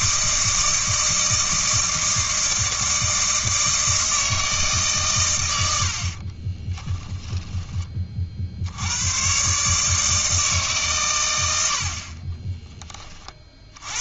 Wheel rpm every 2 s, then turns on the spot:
160, 160, 140, 20, 90, 140, 20.
6-8